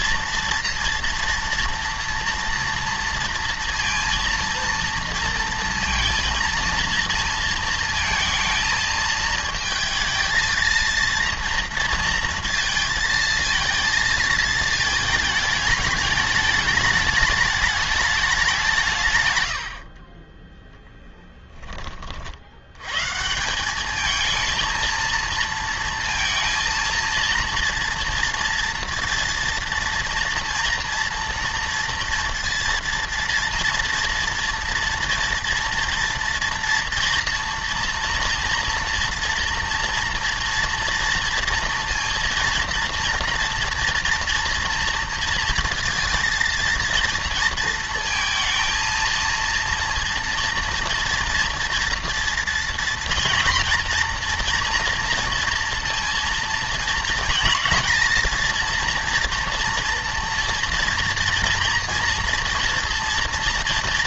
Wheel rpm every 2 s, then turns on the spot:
230, 230, 230, 230, 220, 220, 230, 220, 210, 180, 10, 100, 230, 230, 230, 230, 230, 230, 230, 230, 230, 230, 230, 230, 230, 230, 230, 240, 230, 230, 230, 230.
none